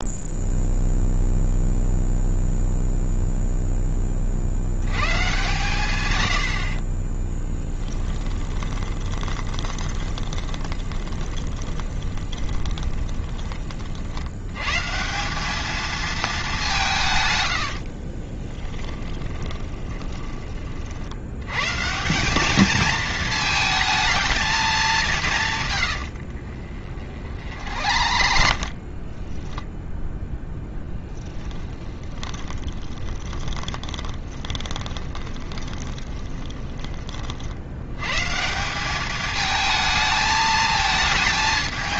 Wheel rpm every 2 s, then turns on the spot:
0, 0, 90, 40, 20, 20, 20, 130, 170, 10, 50, 220, 200, 40, 50, 10, 20, 20, 30, 190, 220.
6-14 18-20 26-36